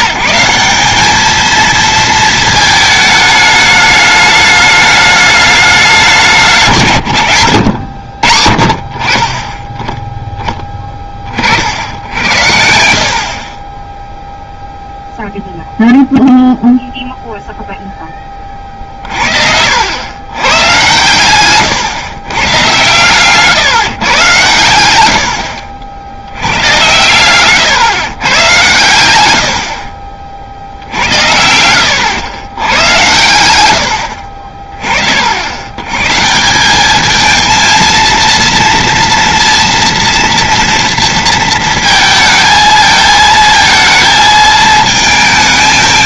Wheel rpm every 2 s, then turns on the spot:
190, 220, 210, 170, 40, 10, 80, 0, 0, 40, 120, 130, 100, 100, 100, 70, 110, 40, 190, 230, 230, 230, 220.
none